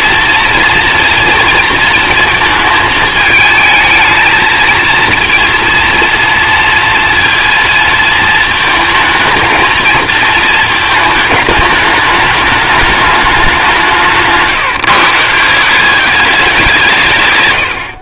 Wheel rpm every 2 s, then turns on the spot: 230, 230, 220, 230, 230, 230, 210, 180, 200.
none